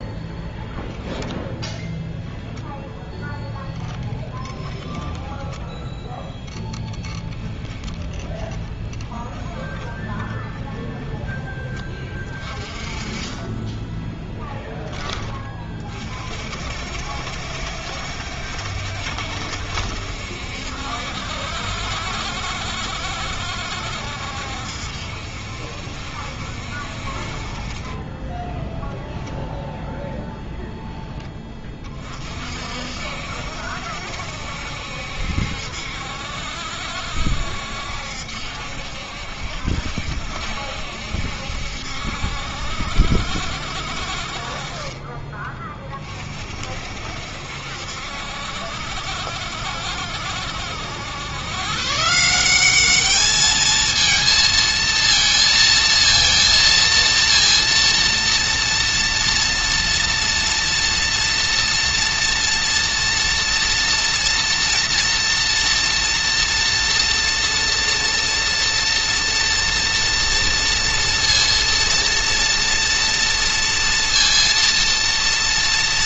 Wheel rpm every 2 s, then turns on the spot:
0, 0, 10, 10, 20, 10, 30, 20, 60, 60, 70, 60, 60, 50, 0, 0, 60, 70, 70, 70, 70, 70, 30, 50, 60, 80, 200, 230, 230, 240, 240, 240, 230, 230, 240, 230, 230, 230.
4-16 44-46